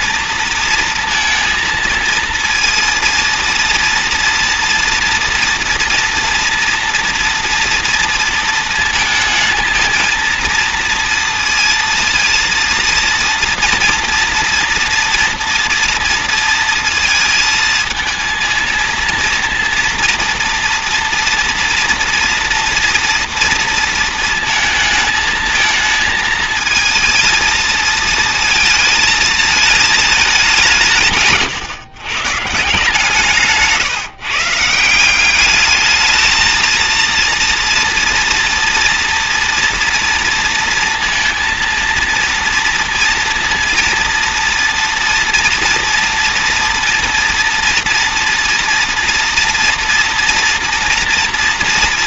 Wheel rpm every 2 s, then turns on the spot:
230, 230, 230, 230, 220, 230, 230, 230, 230, 230, 230, 230, 230, 220, 220, 160, 150, 170, 230, 230, 230, 230, 230, 230, 230, 230.
none